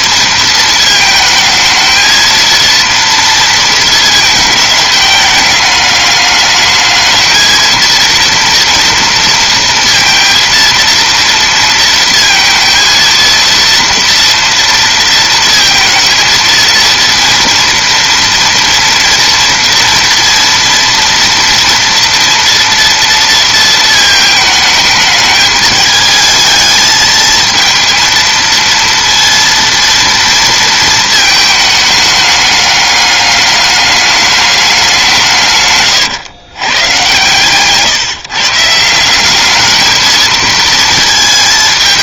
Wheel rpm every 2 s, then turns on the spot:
220, 230, 220, 210, 230, 230, 230, 230, 230, 230, 230, 230, 220, 220, 230, 230, 210, 200, 110, 160, 220.
none